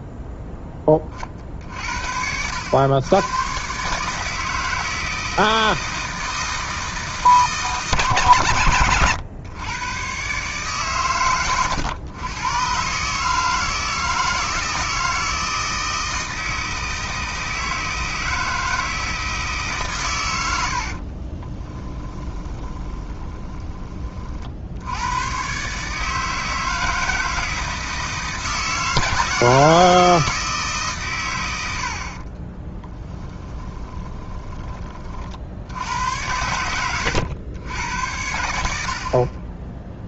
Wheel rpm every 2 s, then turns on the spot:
40, 110, 160, 160, 120, 110, 150, 160, 160, 160, 30, 20, 110, 160, 160, 120, 10, 50, 90, 30.
20-24 32-34